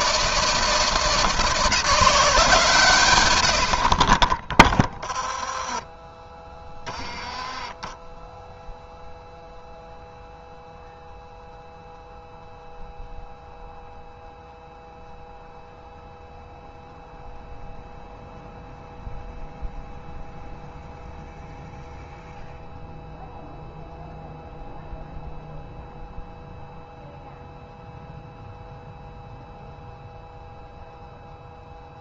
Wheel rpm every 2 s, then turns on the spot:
160, 140, 10, 10, 0, 0, 0, 0, 0, 0, 0, 0, 0, 0, 0, 0.
none